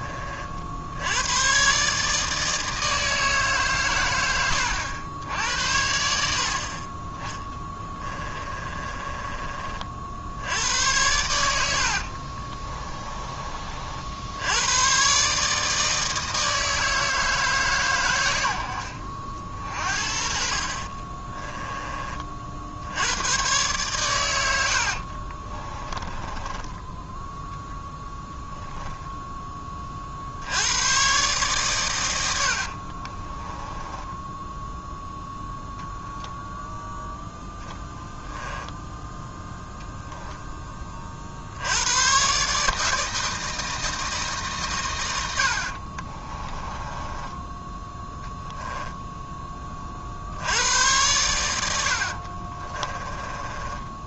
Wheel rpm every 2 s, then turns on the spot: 60, 160, 90, 50, 30, 80, 30, 100, 160, 70, 40, 60, 80, 10, 0, 80, 70, 0, 0, 10, 10, 150, 120, 20, 0, 90, 30.
8-10 12-14 24-28 32-34 46-48 52-54